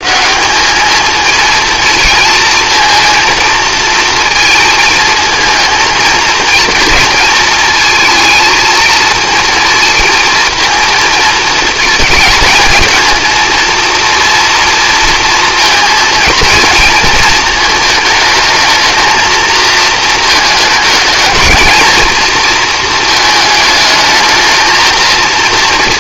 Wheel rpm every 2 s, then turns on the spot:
210, 230, 220, 230, 230, 230, 230, 230, 220, 220, 220, 230, 220.
none